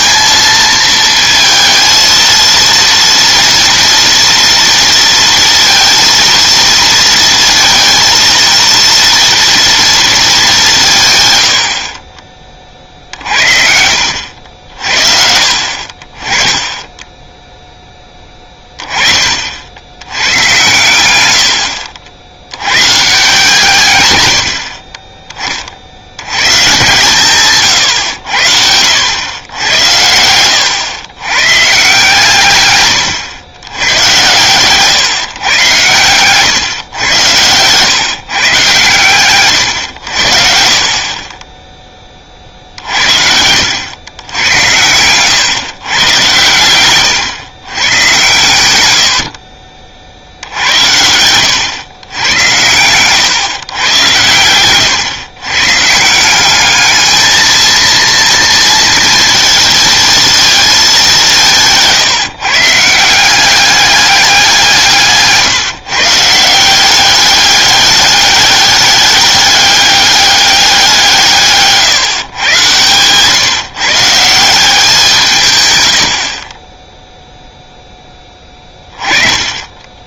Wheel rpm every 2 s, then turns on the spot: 220, 230, 230, 230, 230, 180, 40, 60, 20, 20, 120, 110, 50, 130, 80, 100, 130, 130, 120, 130, 50, 50, 100, 120, 100, 80, 110, 110, 200, 230, 220, 150, 180, 180, 200, 190, 120, 180, 20, 20.
none